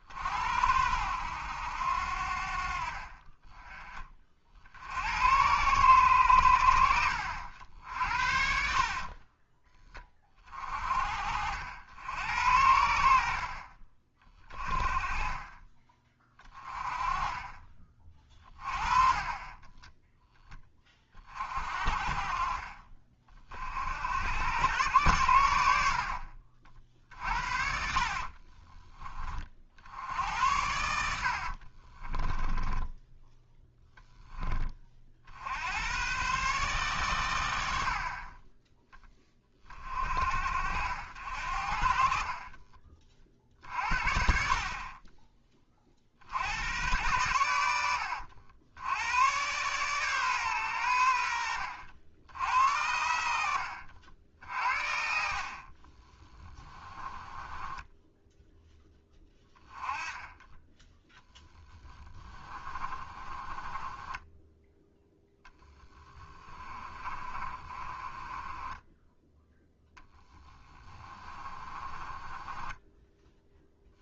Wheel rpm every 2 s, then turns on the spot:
80, 40, 60, 80, 50, 40, 70, 30, 20, 30, 20, 40, 100, 50, 30, 80, 10, 30, 130, 10, 70, 40, 30, 110, 90, 100, 80, 50, 10, 10, 10, 30, 10, 30, 10, 20, 10.
8-10 26-28 32-34 56-58 62-64 66-74